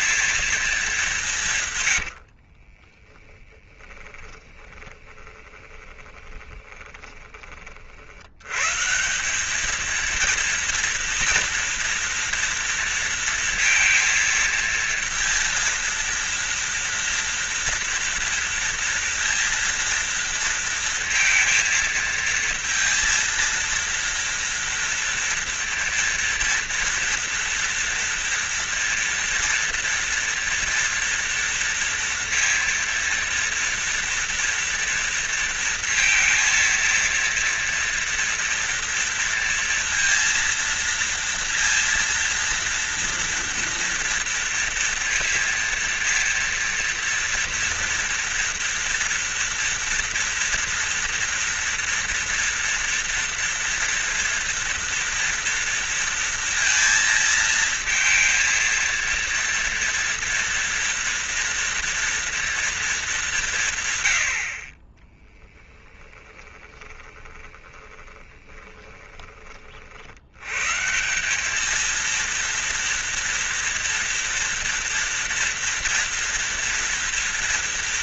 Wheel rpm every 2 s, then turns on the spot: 210, 40, 20, 20, 140, 230, 230, 230, 230, 230, 230, 230, 230, 230, 230, 230, 230, 230, 230, 230, 230, 230, 230, 230, 240, 230, 230, 230, 230, 230, 230, 230, 40, 20, 20, 140, 230, 230, 230.
2-8 66-70